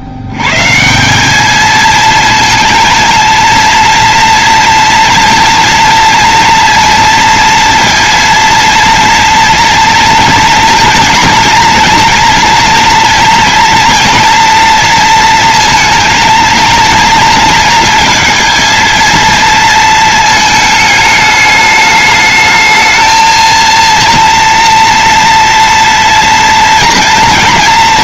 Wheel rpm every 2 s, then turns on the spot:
140, 230, 240, 230, 230, 240, 230, 230, 230, 230, 220, 220, 240, 240.
none